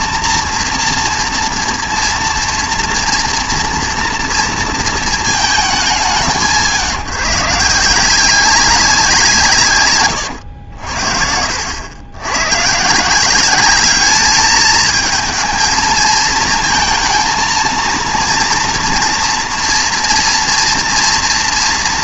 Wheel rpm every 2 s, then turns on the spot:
230, 230, 230, 160, 190, 90, 130, 220, 220, 230, 230.
none